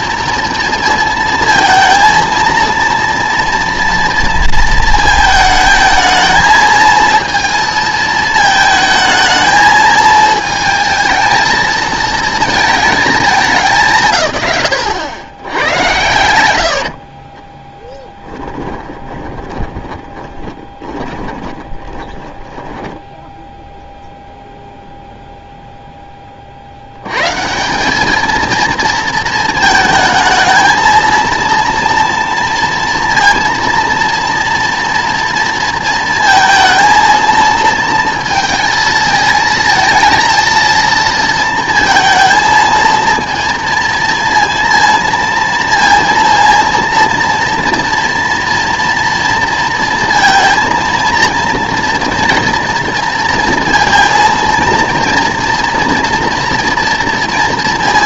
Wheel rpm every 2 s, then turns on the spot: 230, 230, 230, 220, 220, 220, 220, 90, 70, 10, 20, 10, 0, 80, 230, 220, 230, 230, 230, 230, 230, 230, 230, 230, 230, 230, 230, 230, 230.
16-24